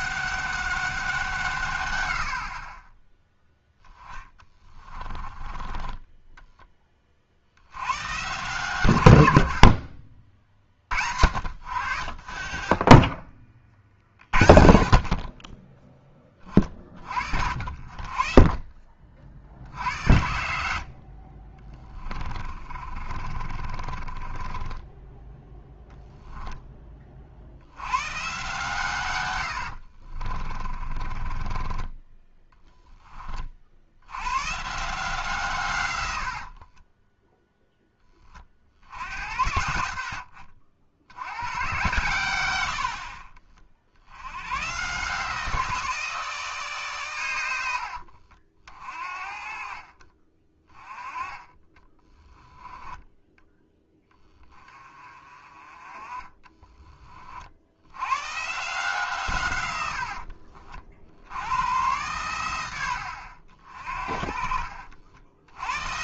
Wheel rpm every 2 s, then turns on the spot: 190, 30, 20, 20, 130, 60, 30, 50, 40, 40, 70, 30, 20, 20, 130, 30, 20, 150, 20, 60, 80, 80, 130, 140, 40, 20, 10, 20, 20, 150, 60, 90, 50.
4-6 12-14 22-26 30-34 36-38